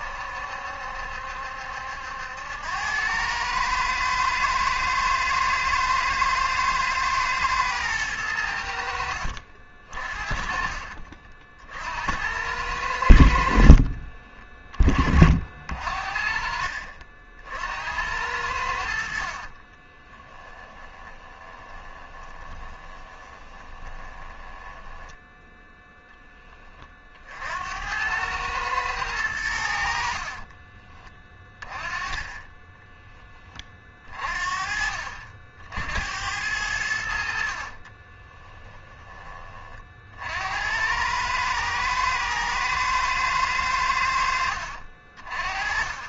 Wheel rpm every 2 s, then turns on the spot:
70, 90, 110, 110, 80, 40, 90, 30, 50, 80, 20, 20, 10, 20, 110, 30, 10, 40, 80, 10, 80, 110, 50.
14-16 20-26